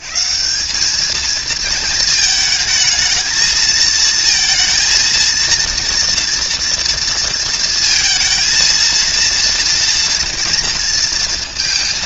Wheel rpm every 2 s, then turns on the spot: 190, 220, 230, 230, 230, 230.
none